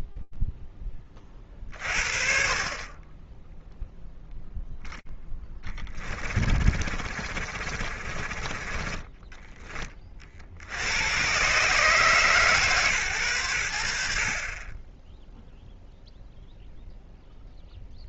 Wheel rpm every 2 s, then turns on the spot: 40, 0, 10, 60, 10, 130, 100, 0, 0.
4-8